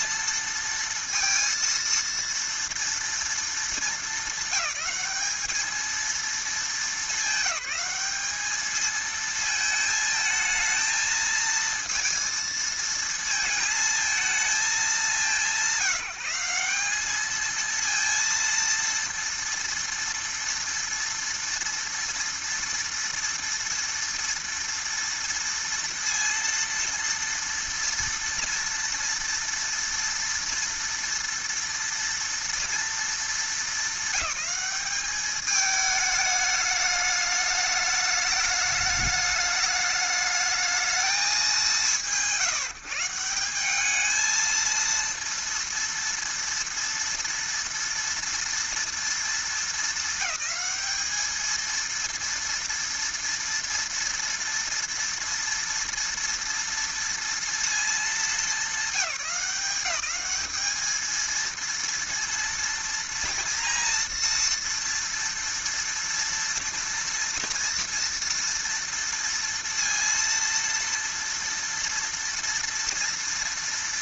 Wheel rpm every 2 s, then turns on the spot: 230, 230, 200, 220, 220, 220, 220, 200, 200, 230, 240, 230, 230, 230, 230, 230, 230, 210, 210, 210, 220, 160, 230, 230, 230, 220, 230, 230, 230, 210, 220, 230, 230, 230, 230, 230, 230.
none